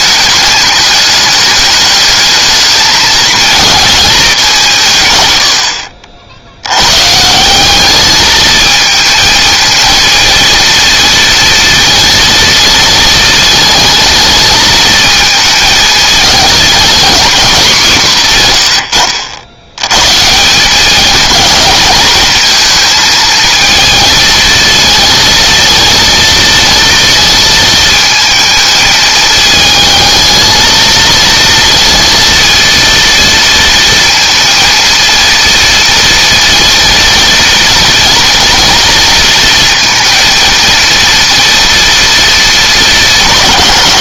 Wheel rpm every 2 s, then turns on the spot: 210, 220, 180, 90, 220, 230, 230, 220, 230, 100, 180, 220, 230, 230, 220, 220, 230, 230, 230, 230, 230, 210.
none